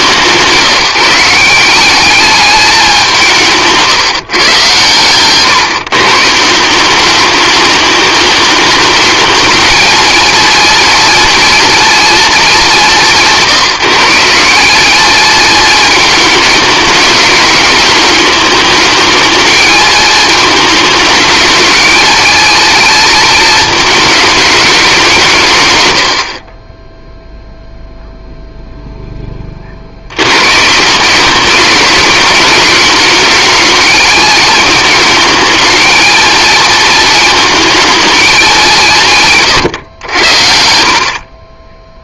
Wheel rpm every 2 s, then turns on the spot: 170, 190, 120, 190, 210, 230, 200, 210, 220, 220, 220, 220, 190, 10, 0, 170, 220, 220, 230, 180, 50.
none